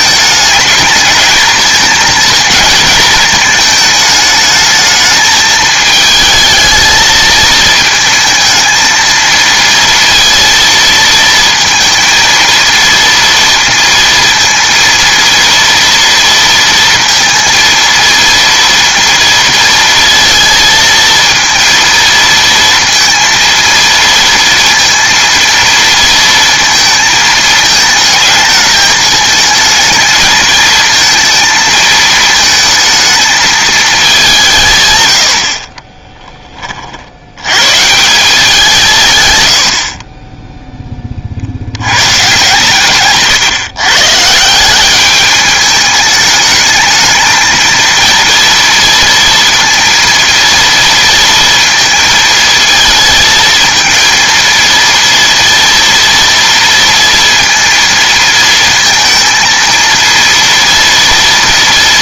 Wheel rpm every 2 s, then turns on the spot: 220, 230, 210, 220, 220, 230, 230, 230, 230, 230, 220, 230, 230, 230, 220, 220, 220, 150, 30, 180, 10, 140, 190, 220, 230, 230, 230, 230, 230, 230, 230.
none